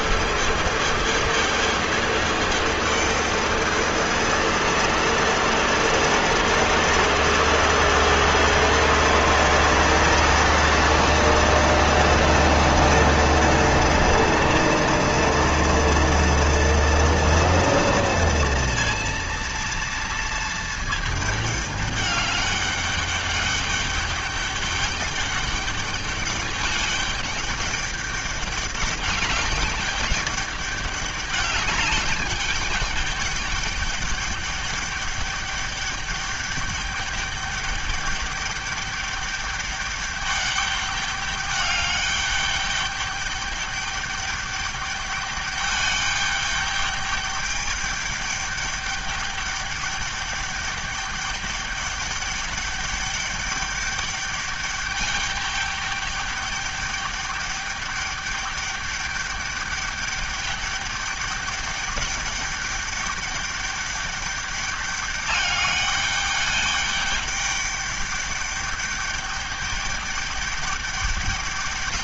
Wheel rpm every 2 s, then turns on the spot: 220, 220, 230, 230, 230, 230, 230, 230, 230, 230, 230, 200, 200, 200, 200, 200, 200, 200, 200, 200, 200, 200, 200, 210, 210, 210, 210, 210, 210, 210, 200, 200, 210, 210, 200, 210.
none